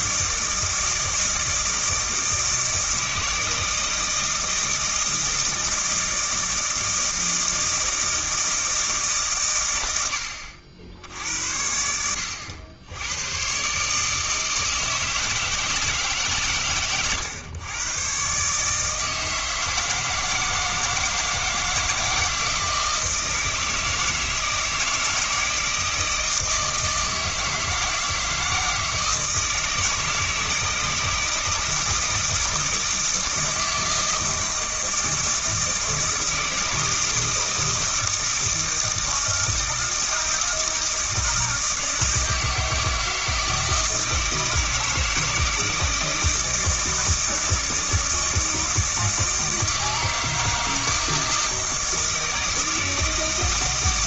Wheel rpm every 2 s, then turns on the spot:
160, 160, 160, 160, 150, 70, 90, 160, 130, 150, 160, 160, 160, 160, 160, 160, 160, 160, 160, 160, 160, 160, 160, 160, 160, 160, 160.
16-18